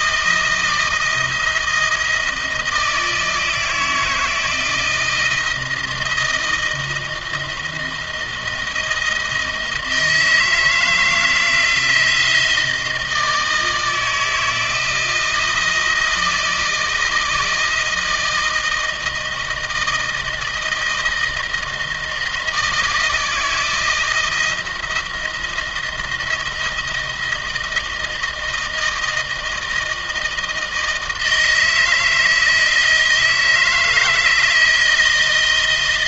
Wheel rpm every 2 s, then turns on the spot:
160, 160, 160, 160, 160, 160, 160, 170, 160, 160, 160, 160, 160, 160, 160, 160, 160, 160.
none